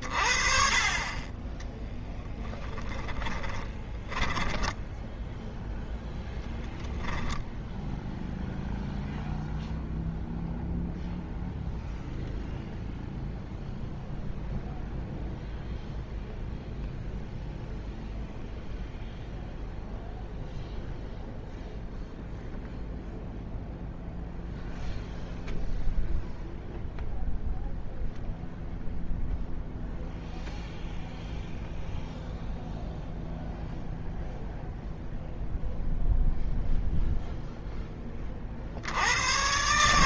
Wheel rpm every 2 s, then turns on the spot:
30, 10, 10, 10, 0, 0, 0, 0, 0, 0, 0, 0, 0, 0, 0, 0, 0, 0, 0, 80.
2-4